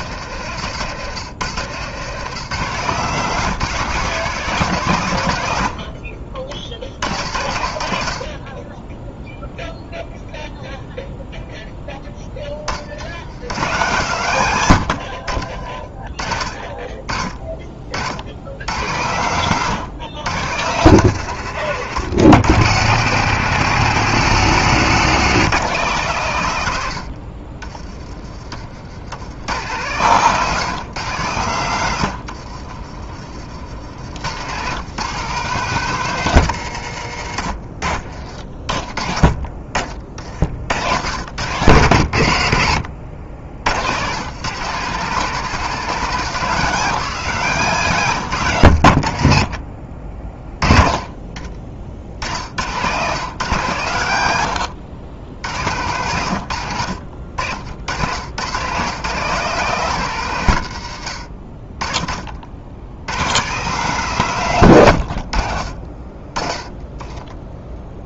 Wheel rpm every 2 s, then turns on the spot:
120, 150, 140, 40, 10, 0, 20, 100, 30, 80, 130, 110, 150, 110, 60, 150, 60, 130, 130, 30, 60, 80, 160, 170, 110, 20, 90, 100, 90, 110, 120, 80, 120, 30.
32-34 54-56